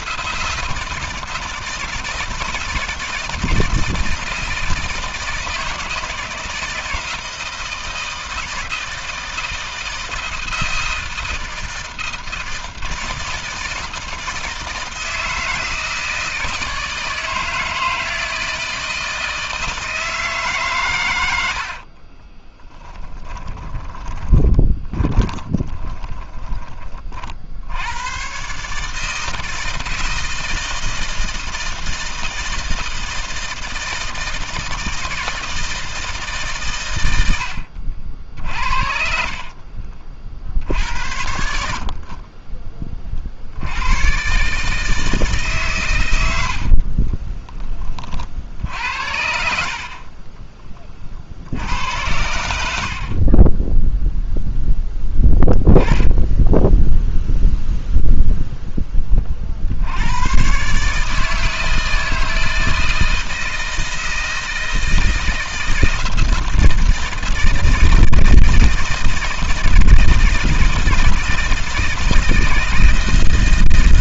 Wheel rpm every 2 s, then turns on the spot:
160, 160, 160, 160, 160, 160, 160, 160, 160, 160, 130, 10, 10, 30, 140, 160, 160, 160, 120, 50, 70, 30, 150, 50, 80, 30, 60, 10, 0, 20, 140, 160, 160, 160, 160, 160, 160.
22-26 38-40 46-48